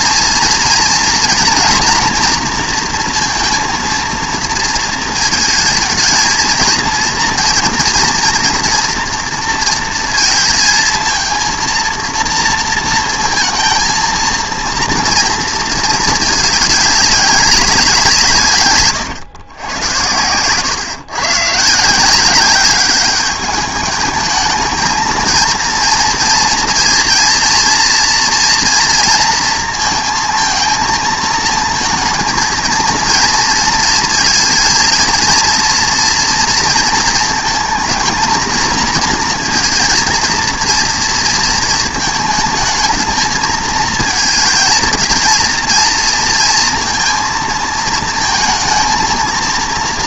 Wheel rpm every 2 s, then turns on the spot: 240, 240, 230, 230, 230, 230, 230, 230, 200, 140, 120, 200, 230, 230, 230, 230, 230, 230, 230, 230, 230, 230, 220, 230, 230.
none